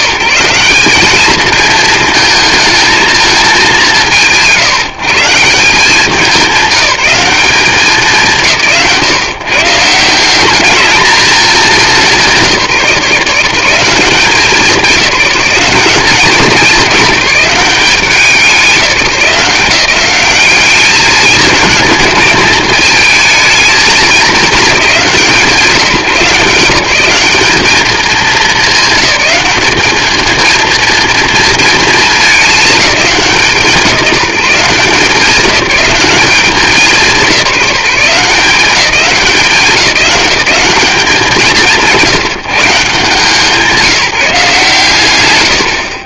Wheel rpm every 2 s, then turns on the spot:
190, 220, 160, 200, 150, 210, 170, 180, 190, 190, 200, 220, 200, 160, 210, 230, 200, 170, 190, 180, 200, 160, 150.
none